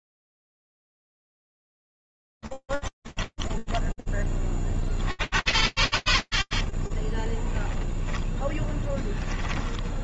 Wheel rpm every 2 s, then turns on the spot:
0, 10, 20, 20, 0.
2-4 6-8